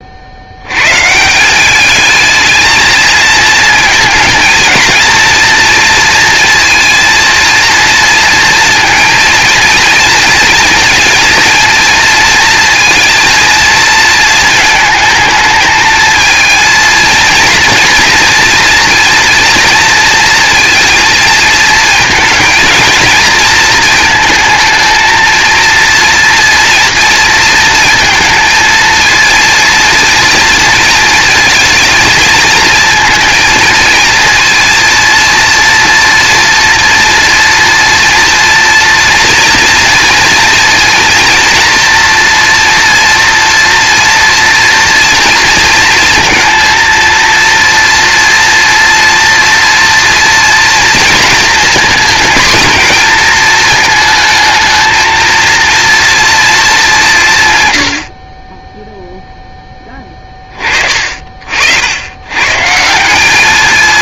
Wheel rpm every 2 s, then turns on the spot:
170, 220, 230, 230, 230, 230, 230, 220, 230, 230, 220, 230, 220, 230, 230, 230, 220, 230, 230, 230, 230, 230, 230, 230, 230, 230, 230, 230, 160, 0, 40, 200.
none